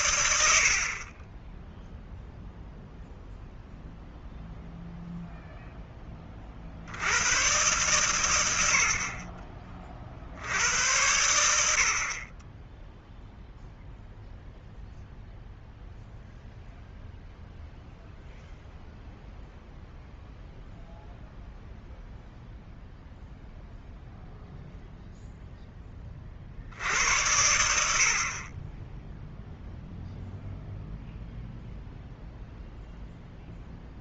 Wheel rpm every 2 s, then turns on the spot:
80, 0, 0, 50, 80, 80, 20, 0, 0, 0, 0, 0, 0, 60, 20, 0, 0.
none